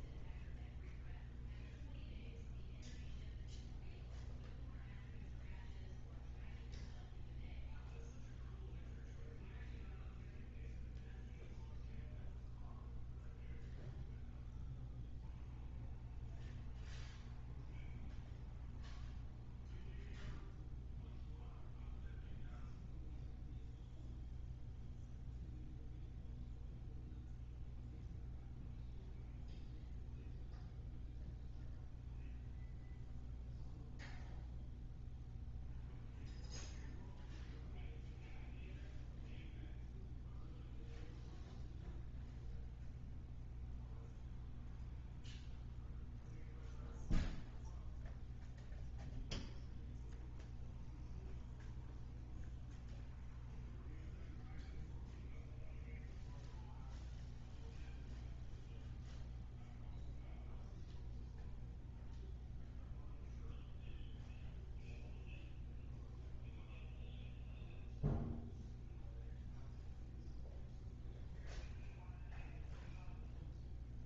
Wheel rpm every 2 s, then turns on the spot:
0, 0, 0, 0, 0, 0, 0, 0, 0, 0, 0, 0, 0, 0, 0, 0, 0, 0, 0, 0, 0, 0, 0, 0, 0, 0, 0, 0, 0, 0, 0, 0, 0, 0, 0, 0, 0.
none